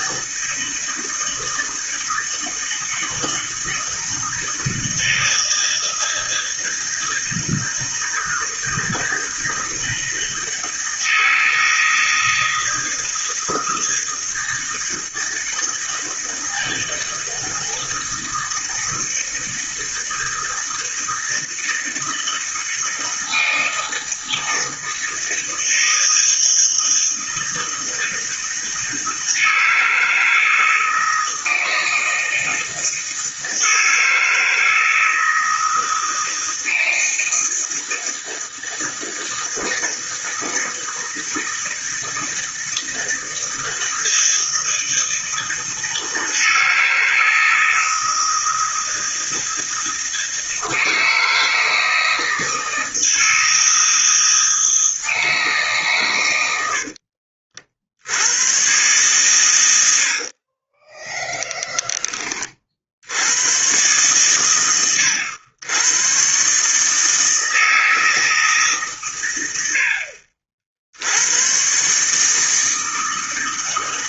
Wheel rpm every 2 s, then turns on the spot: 160, 160, 160, 160, 160, 160, 160, 160, 160, 160, 160, 160, 160, 160, 160, 160, 160, 160, 160, 160, 160, 160, 160, 160, 160, 160, 160, 160, 70, 120, 30, 60, 110, 150, 140, 60, 160.
56-58 60-62